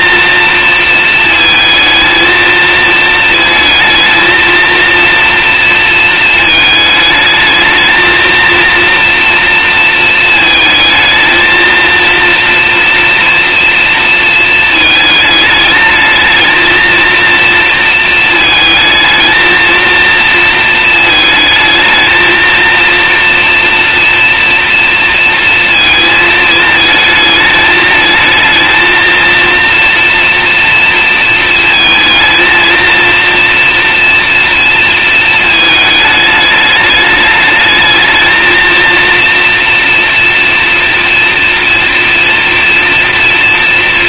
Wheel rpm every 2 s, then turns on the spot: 230, 230, 230, 220, 240, 220, 240, 220, 230, 220, 220, 230, 230, 220, 230, 230, 230, 230, 210, 230, 230, 230.
none